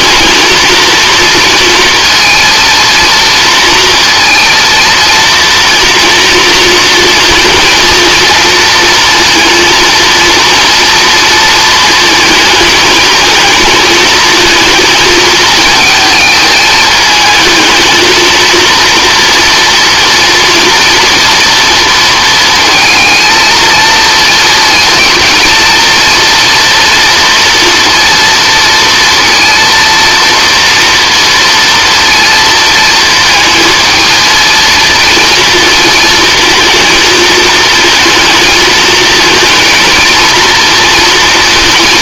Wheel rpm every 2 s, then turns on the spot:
230, 230, 230, 230, 230, 230, 220, 220, 220, 230, 230, 230, 230, 230, 230, 230, 230, 230, 220, 220, 230.
none